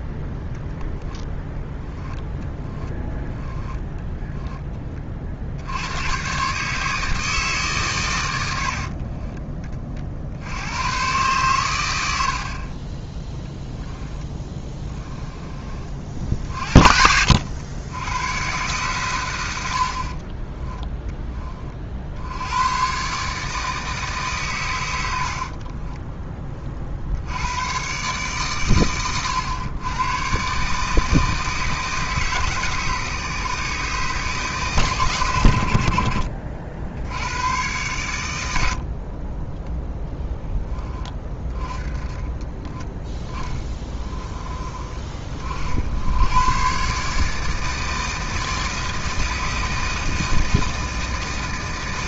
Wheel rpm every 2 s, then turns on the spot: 0, 10, 10, 140, 70, 90, 30, 20, 50, 120, 10, 110, 110, 40, 120, 150, 150, 130, 70, 80, 20, 20, 20, 120, 160, 160.
2-4 8-10 12-16 20-22 42-44